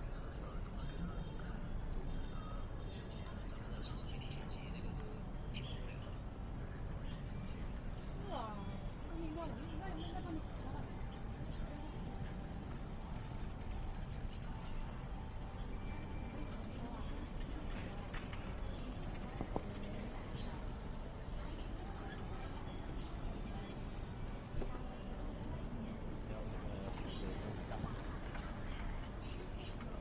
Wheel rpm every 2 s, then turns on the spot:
0, 0, 0, 0, 0, 0, 0, 0, 0, 0, 0, 0, 0, 0, 0.
none